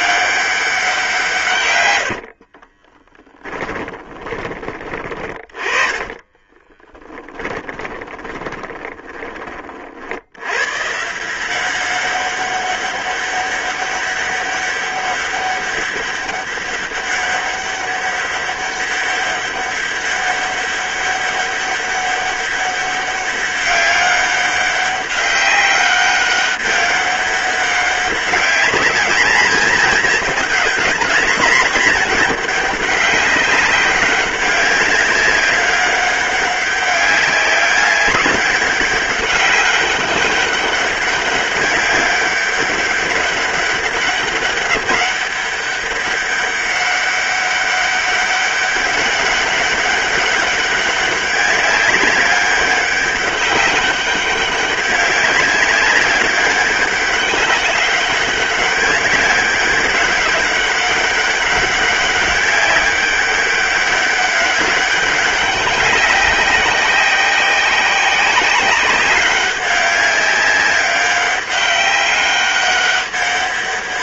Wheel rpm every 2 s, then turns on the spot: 170, 20, 20, 20, 30, 160, 200, 200, 200, 200, 200, 200, 200, 200, 210, 210, 200, 200, 200, 200, 200, 200, 200, 200, 200, 200, 200, 190, 200, 200, 200, 200, 200, 190, 200, 190, 200.
2-10